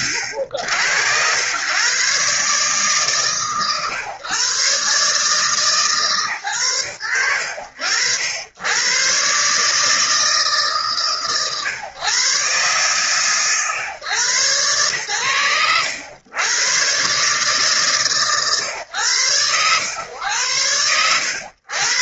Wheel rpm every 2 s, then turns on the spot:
80, 130, 130, 120, 90, 130, 120, 110, 120, 120, 100.
none